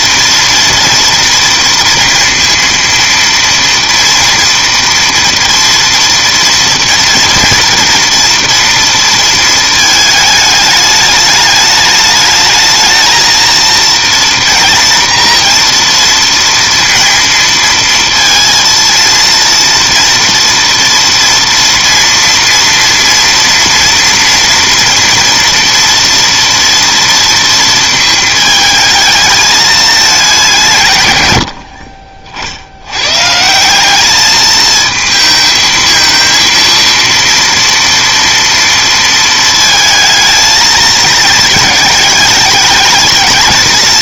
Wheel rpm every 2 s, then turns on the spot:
230, 230, 230, 240, 230, 210, 220, 240, 230, 230, 230, 230, 230, 230, 220, 140, 90, 220, 230, 230, 220, 210.
none